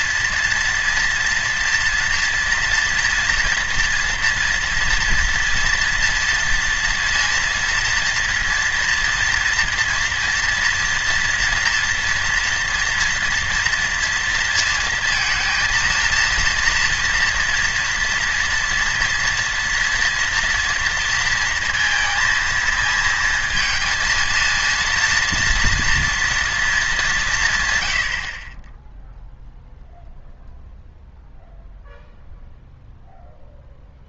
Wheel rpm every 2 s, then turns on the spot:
240, 230, 230, 230, 230, 230, 240, 230, 230, 230, 230, 230, 230, 220, 40, 0, 0.
none